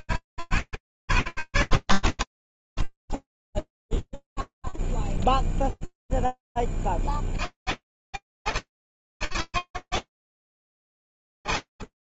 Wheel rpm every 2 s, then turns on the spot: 10, 20, 30, 160, 160, 160.
0-4